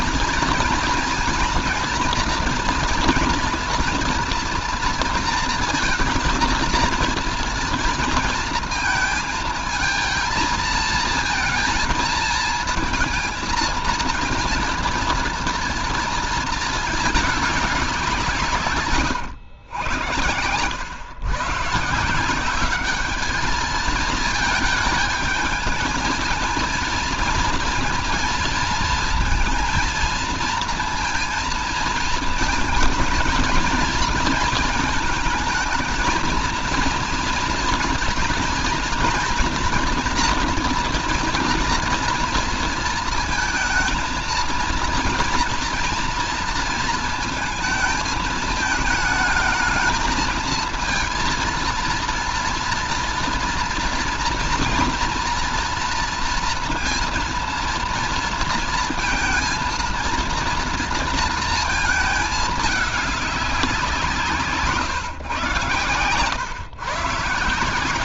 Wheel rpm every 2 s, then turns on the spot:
230, 230, 230, 230, 230, 230, 220, 230, 220, 170, 100, 190, 220, 230, 230, 230, 230, 230, 230, 230, 230, 230, 220, 230, 220, 220, 230, 230, 230, 230, 230, 210, 160, 130.
none